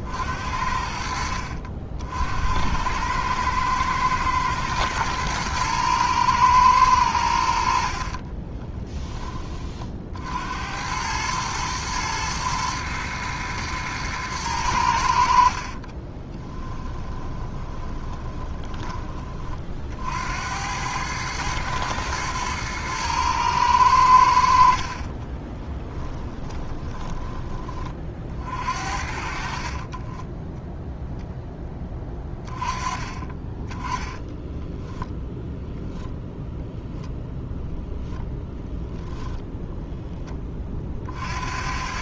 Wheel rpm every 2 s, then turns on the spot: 70, 80, 110, 110, 20, 80, 110, 100, 10, 20, 90, 110, 60, 10, 50, 0, 20, 10, 0, 0, 30.
8-10 16-20 26-28